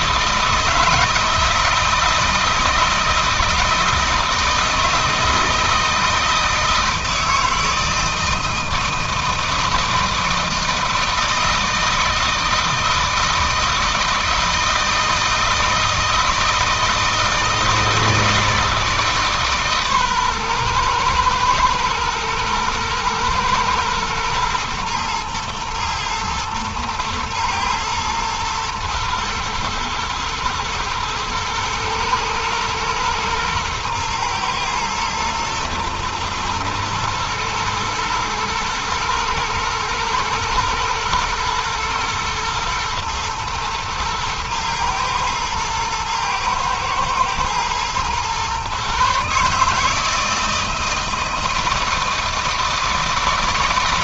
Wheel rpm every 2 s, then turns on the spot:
160, 160, 160, 160, 160, 160, 160, 160, 160, 150, 120, 120, 120, 110, 120, 110, 110, 110, 110, 110, 110, 120, 110, 110, 140, 160, 160.
none